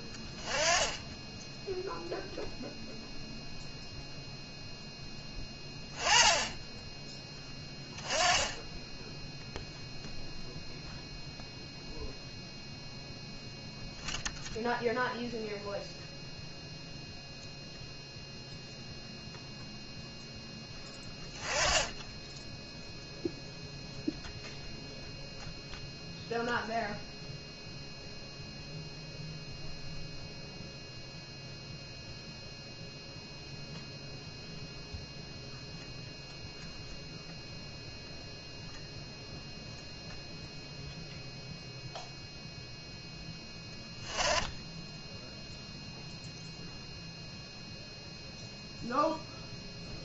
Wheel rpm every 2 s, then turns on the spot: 20, 0, 0, 10, 10, 0, 0, 0, 0, 0, 10, 0, 0, 0, 0, 0, 0, 0, 0, 0, 0, 0, 10, 0, 0.
none